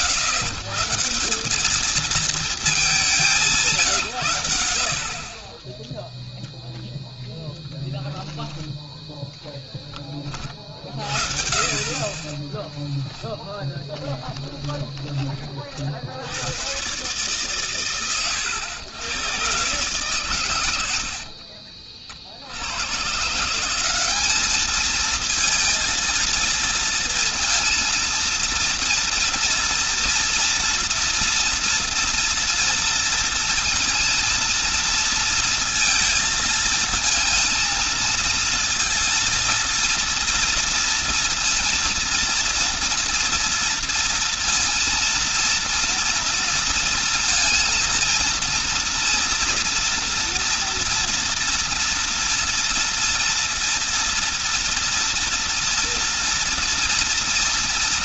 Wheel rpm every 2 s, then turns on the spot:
120, 210, 120, 0, 10, 40, 20, 20, 90, 100, 110, 60, 200, 230, 230, 230, 230, 230, 230, 230, 230, 230, 230, 230, 230, 230, 230, 230, 230.
12-16